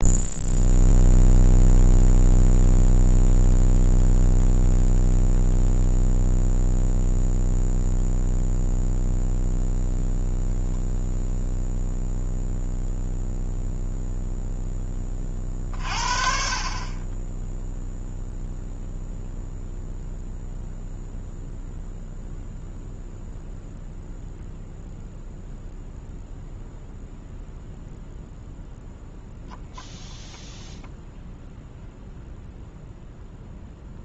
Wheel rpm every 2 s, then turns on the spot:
0, 0, 0, 0, 0, 0, 0, 0, 40, 0, 0, 0, 0, 0, 0, 0, 0.
none